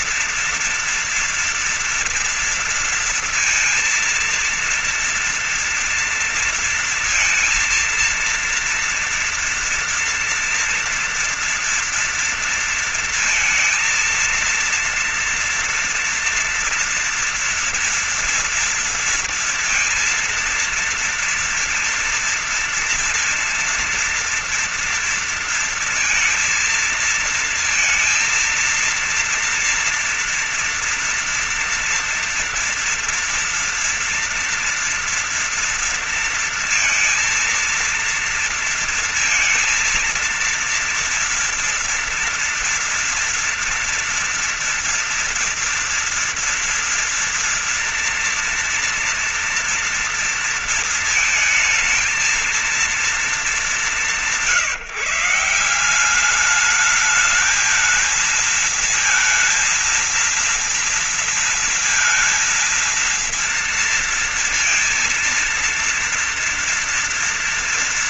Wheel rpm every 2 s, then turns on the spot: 230, 230, 230, 230, 230, 230, 230, 230, 230, 230, 230, 230, 230, 230, 230, 240, 230, 230, 230, 230, 230, 230, 230, 230, 240, 230, 220, 190, 190, 220, 230, 230, 230, 230.
none